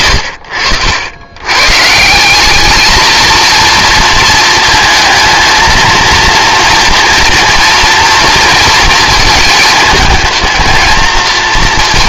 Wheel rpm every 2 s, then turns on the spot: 70, 210, 230, 230, 230, 220.
0-2